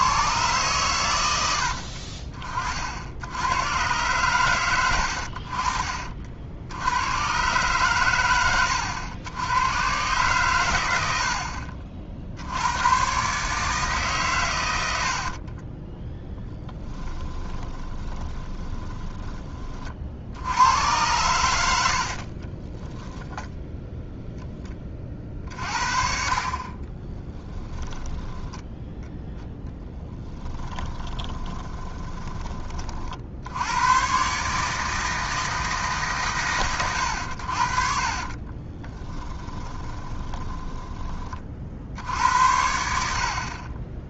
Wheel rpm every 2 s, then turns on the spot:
120, 60, 100, 90, 100, 100, 100, 90, 10, 20, 90, 10, 30, 30, 10, 20, 40, 150, 110, 30, 20, 70.
16-20 22-24 26-28 30-32 38-42